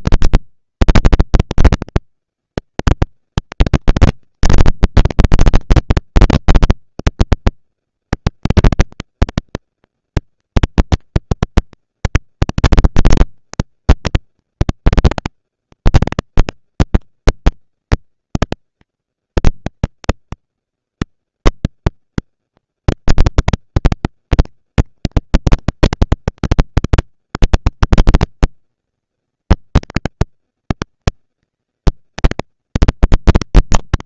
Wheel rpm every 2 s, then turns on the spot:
230, 230, 230, 230, 230, 230, 230, 230, 200, 170, 110, 190, 200, 200, 220, 230, 230.
none